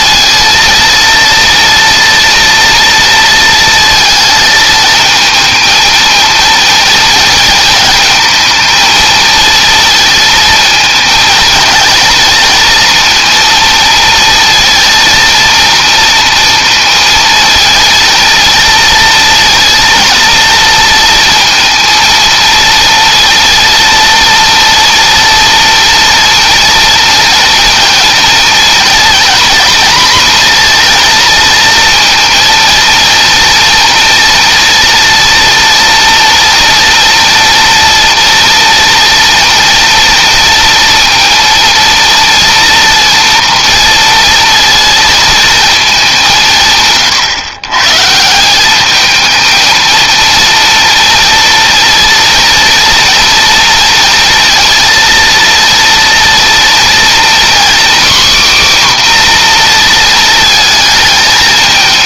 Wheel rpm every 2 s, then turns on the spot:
230, 230, 220, 230, 220, 220, 230, 230, 230, 230, 230, 230, 230, 230, 230, 240, 230, 230, 230, 230, 230, 230, 230, 150, 190, 230, 230, 230, 230, 270, 220.
none